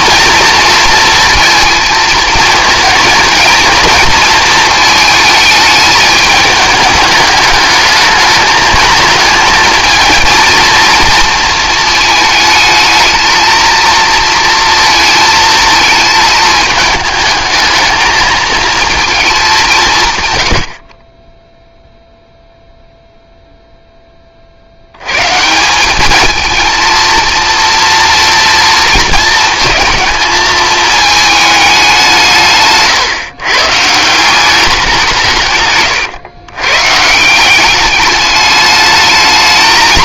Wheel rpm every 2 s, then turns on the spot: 230, 230, 220, 210, 220, 230, 220, 230, 220, 230, 50, 0, 80, 220, 230, 220, 140, 190, 140, 210.
none